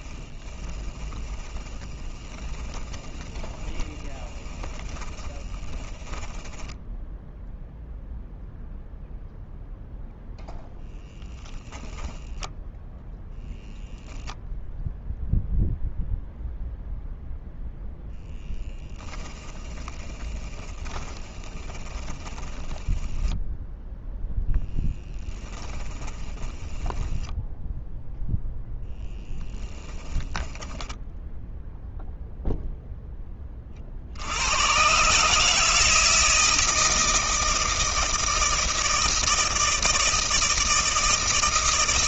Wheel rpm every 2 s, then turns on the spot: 20, 20, 20, 10, 0, 10, 10, 0, 0, 10, 20, 10, 10, 10, 0, 10, 0, 120, 160, 160, 160.
0-6 18-28 30-32